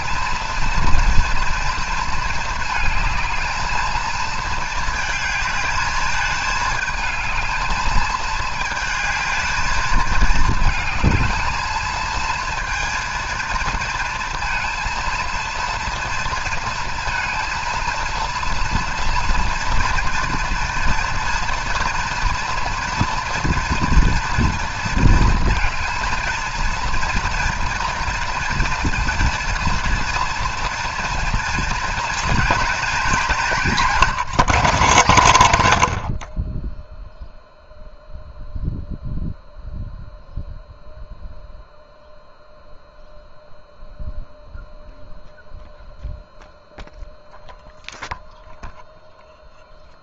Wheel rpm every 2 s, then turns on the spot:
230, 220, 220, 220, 220, 220, 230, 230, 230, 240, 240, 230, 230, 230, 230, 240, 240, 200, 10, 0, 0, 0, 0, 0, 0.
none